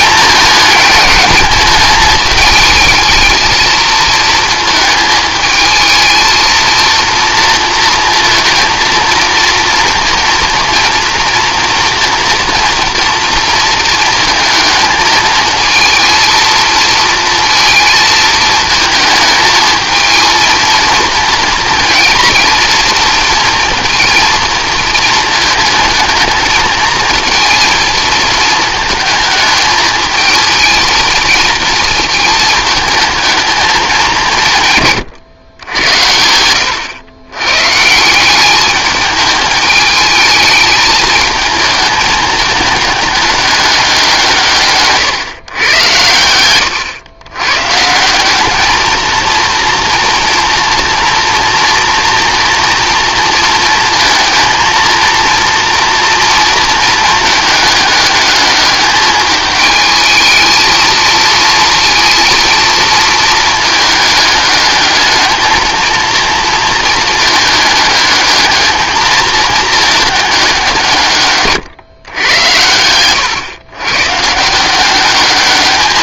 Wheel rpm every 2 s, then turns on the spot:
210, 220, 220, 230, 230, 230, 230, 220, 230, 220, 230, 230, 230, 230, 220, 230, 220, 130, 110, 210, 220, 220, 140, 120, 220, 230, 230, 230, 230, 210, 230, 220, 210, 220, 220, 170, 110, 190.
none